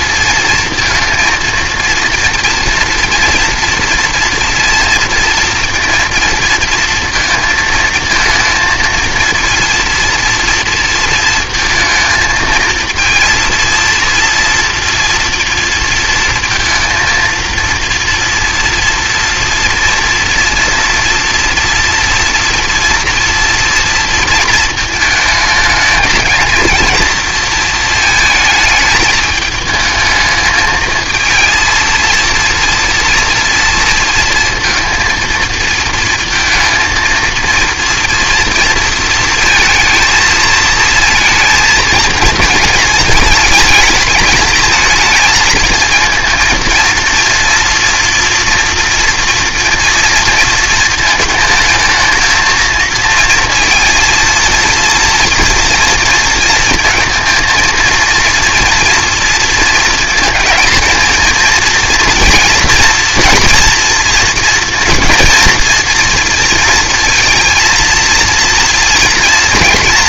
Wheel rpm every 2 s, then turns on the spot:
230, 230, 230, 230, 230, 230, 230, 230, 230, 240, 230, 230, 220, 230, 220, 220, 230, 230, 230, 230, 230, 220, 220, 230, 230, 230, 220, 230, 230, 230, 220, 230, 220, 230, 230.
none